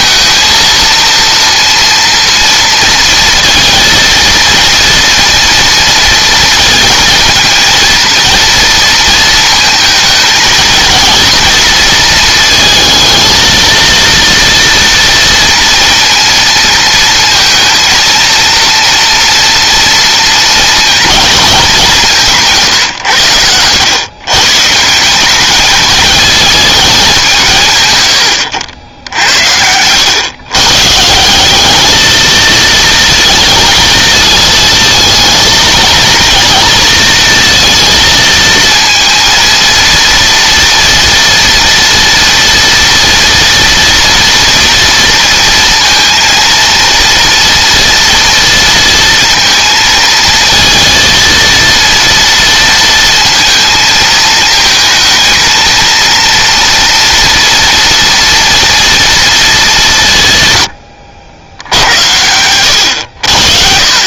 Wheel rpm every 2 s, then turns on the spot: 230, 230, 230, 230, 230, 230, 220, 230, 230, 230, 220, 120, 190, 190, 80, 150, 230, 220, 230, 230, 230, 230, 230, 230, 230, 230, 230, 220, 230, 230, 80, 90.
none